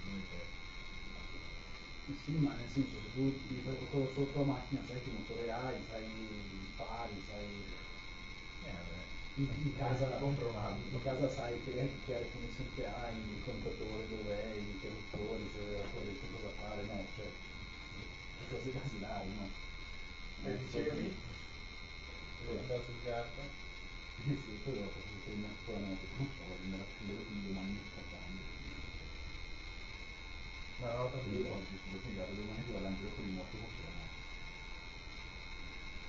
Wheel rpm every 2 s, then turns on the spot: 0, 0, 0, 0, 0, 0, 0, 0, 0, 0, 0, 0, 0, 0, 0, 0, 0, 0.
none